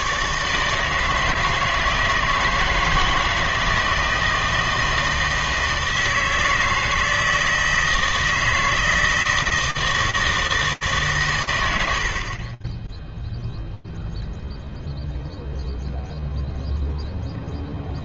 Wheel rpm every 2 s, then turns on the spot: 140, 160, 160, 160, 160, 160, 50, 0, 0.
none